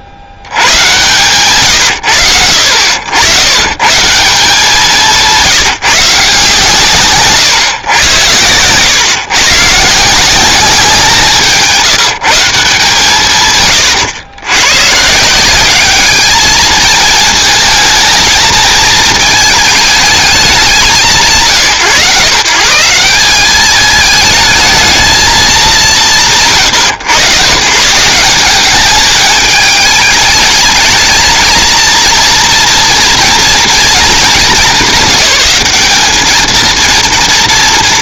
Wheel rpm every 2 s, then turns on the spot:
60, 70, 190, 150, 110, 190, 160, 120, 230, 220, 210, 130, 220, 110, 210, 210, 230, 190, 220.
none